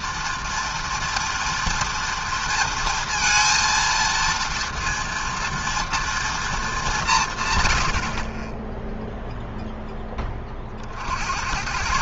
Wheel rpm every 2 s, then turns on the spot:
230, 230, 230, 200, 0, 50.
none